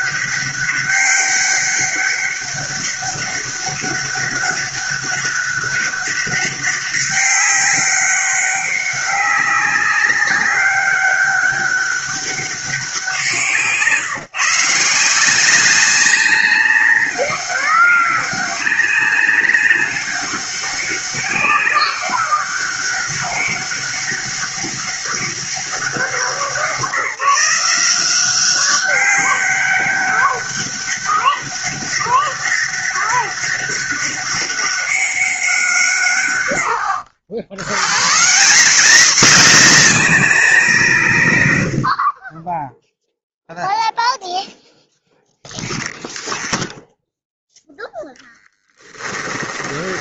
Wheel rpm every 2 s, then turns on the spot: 200, 200, 200, 200, 200, 200, 200, 150, 200, 190, 200, 200, 200, 190, 190, 200, 200, 200, 140, 180, 230, 30, 0, 0, 10.
48-50